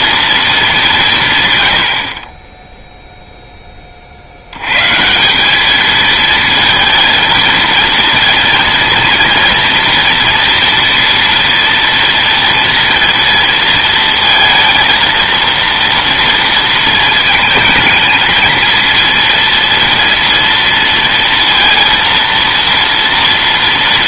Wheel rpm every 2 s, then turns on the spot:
200, 10, 110, 220, 230, 240, 230, 230, 230, 220, 230, 230.
none